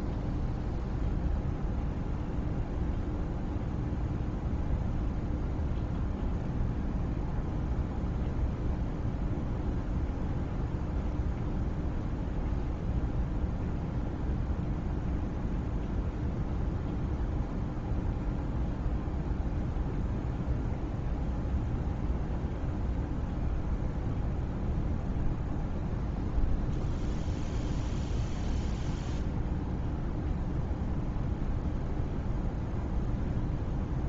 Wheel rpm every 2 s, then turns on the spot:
0, 0, 0, 0, 0, 0, 0, 0, 0, 0, 0, 0, 0, 0, 0, 0, 0.
none